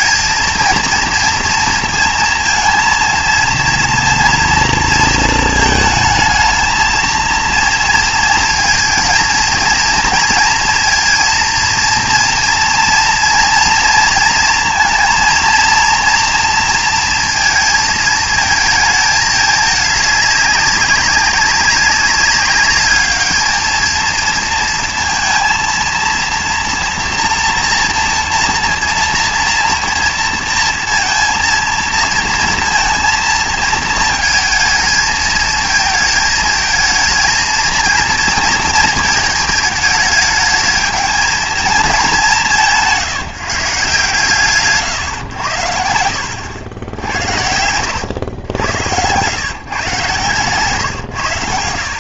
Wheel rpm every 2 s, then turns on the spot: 230, 230, 230, 220, 230, 230, 230, 230, 230, 220, 200, 200, 230, 230, 230, 230, 230, 220, 220, 220, 210, 170, 140, 80, 100, 120.
46-48